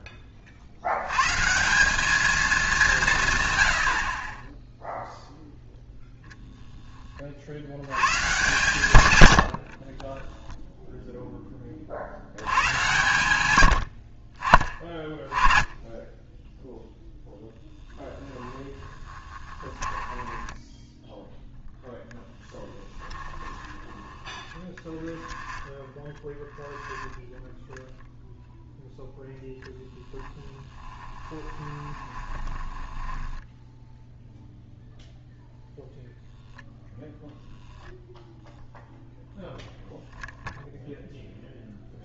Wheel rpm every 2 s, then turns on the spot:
70, 190, 10, 10, 130, 0, 100, 30, 0, 10, 10, 10, 10, 0, 0, 10, 10, 0, 0, 0, 0.
18-26 30-34